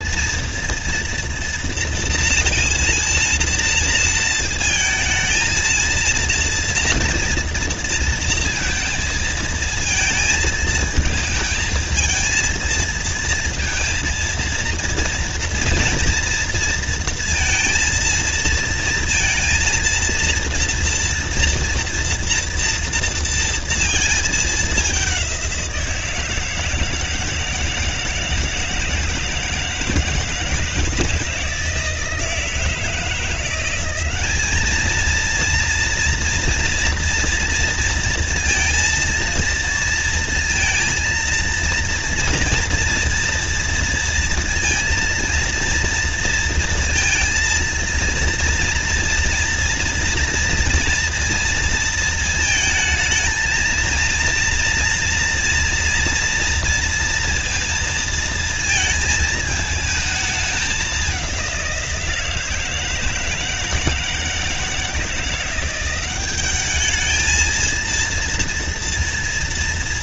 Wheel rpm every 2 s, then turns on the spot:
230, 230, 230, 230, 230, 220, 230, 230, 230, 230, 230, 240, 210, 160, 160, 160, 160, 200, 230, 230, 230, 230, 230, 230, 230, 230, 230, 230, 230, 230, 210, 160, 160, 200, 230.
none